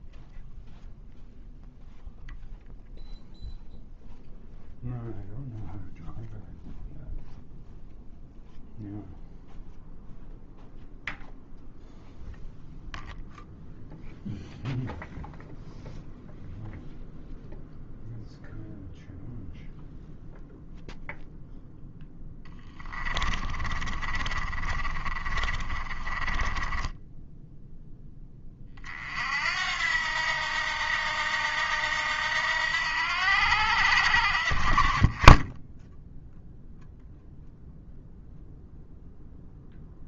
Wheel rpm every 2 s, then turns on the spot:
0, 0, 0, 0, 0, 0, 0, 0, 0, 0, 0, 10, 30, 10, 40, 80, 80, 30, 0, 0.
22-28